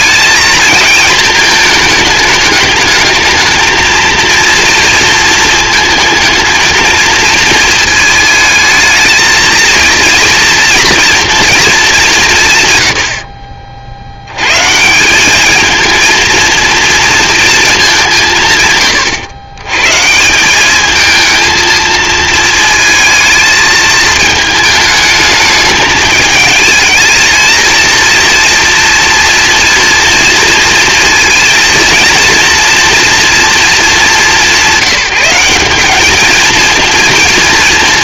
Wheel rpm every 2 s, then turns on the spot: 220, 220, 230, 230, 220, 230, 120, 130, 230, 140, 200, 230, 220, 220, 230, 230, 230, 180, 220.
none